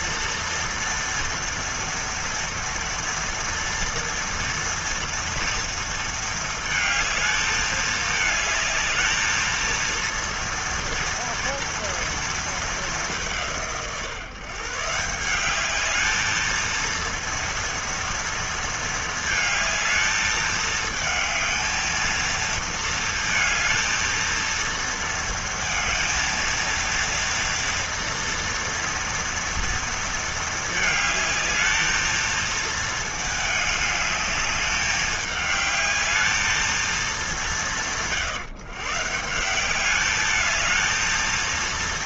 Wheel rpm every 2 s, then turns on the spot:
230, 240, 230, 230, 220, 230, 230, 150, 220, 230, 220, 220, 230, 230, 230, 230, 220, 210, 220, 150, 210.
none